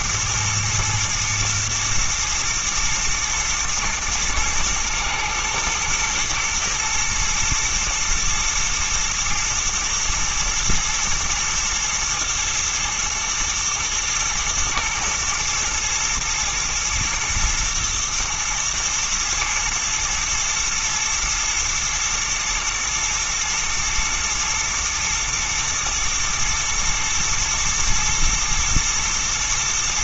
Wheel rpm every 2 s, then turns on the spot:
110, 110, 110, 110, 110, 110, 120, 120, 120, 110, 110, 120, 120, 110, 120.
none